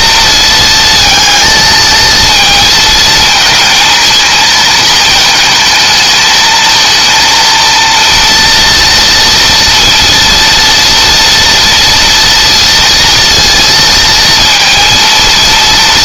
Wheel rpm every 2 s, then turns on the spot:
220, 230, 220, 230, 230, 230, 230, 230.
none